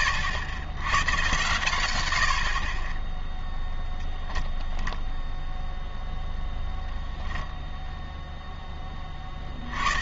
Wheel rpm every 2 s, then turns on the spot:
100, 0, 0, 0, 30.
none